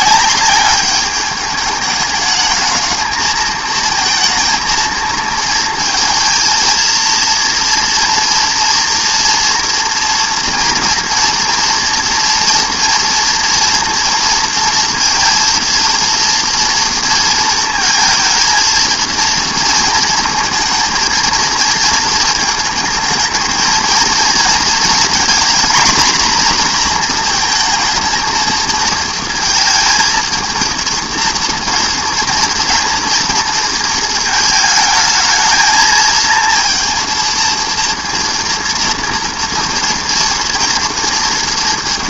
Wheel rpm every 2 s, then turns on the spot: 200, 220, 230, 230, 230, 230, 230, 230, 240, 230, 230, 220, 230, 240, 230, 230, 230, 220, 230, 230, 240.
none